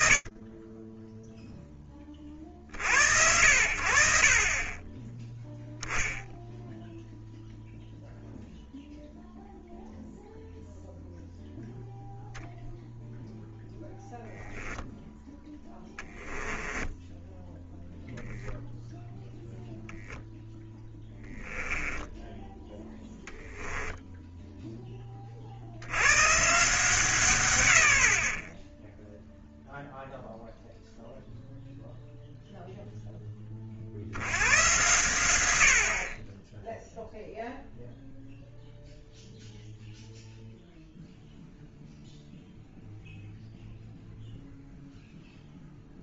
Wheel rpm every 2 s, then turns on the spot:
40, 20, 0, 0, 0, 0, 10, 10, 0, 0, 10, 0, 150, 10, 0, 0, 110, 20, 0, 0, 0, 0, 0.
14-16